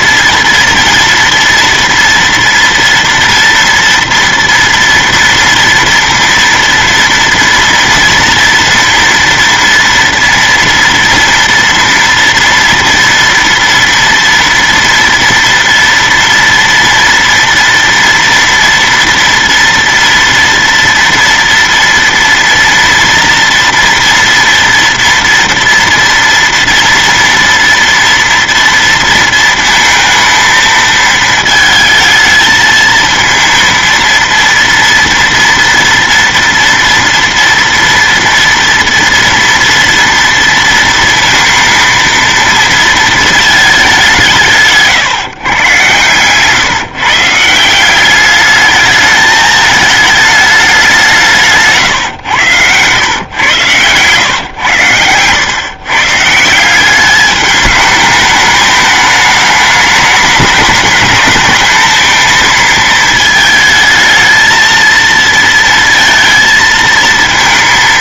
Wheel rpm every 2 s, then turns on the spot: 230, 230, 230, 230, 230, 230, 230, 230, 240, 230, 230, 230, 240, 230, 230, 220, 220, 230, 230, 230, 230, 230, 160, 140, 210, 200, 120, 100, 180, 210, 210, 220, 220, 220.
none